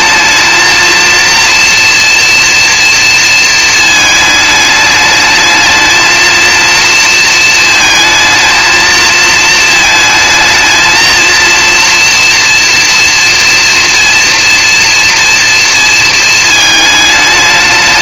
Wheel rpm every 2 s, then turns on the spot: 230, 230, 210, 230, 220, 230, 230, 230, 220.
none